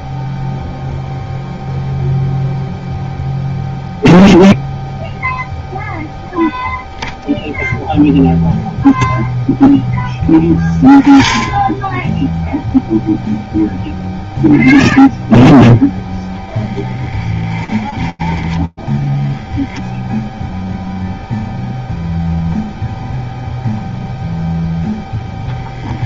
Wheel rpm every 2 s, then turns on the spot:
0, 0, 0, 0, 0, 0, 0, 0, 20, 0, 0, 0, 0.
none